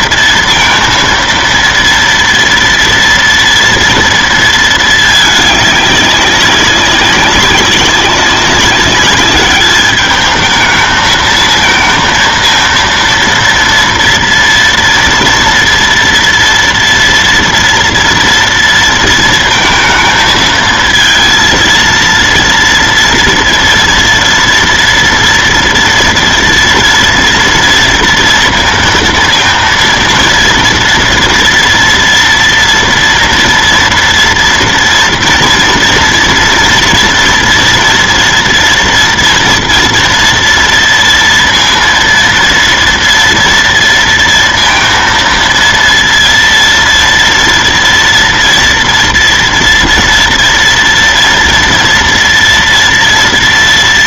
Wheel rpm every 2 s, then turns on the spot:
230, 230, 220, 200, 200, 220, 230, 230, 230, 230, 220, 230, 230, 230, 230, 230, 230, 230, 230, 230, 230, 230, 230, 230, 230, 230, 230.
none